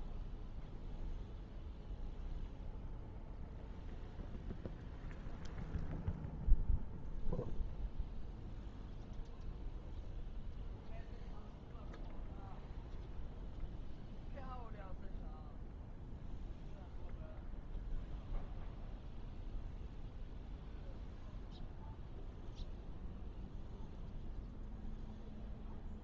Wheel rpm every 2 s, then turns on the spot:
0, 0, 0, 0, 0, 0, 0, 0, 0, 0, 0, 0, 0.
none